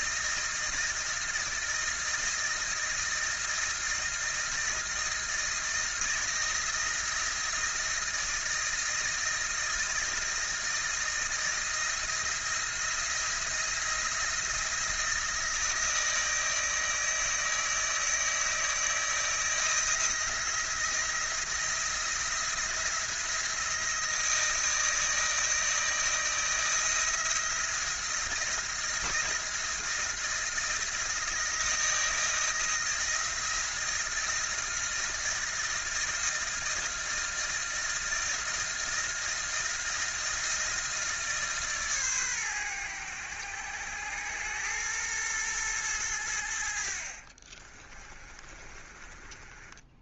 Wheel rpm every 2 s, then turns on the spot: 160, 160, 160, 160, 160, 160, 170, 160, 160, 160, 170, 170, 160, 170, 160, 160, 160, 160, 160, 160, 160, 100, 110, 60, 30.
46-50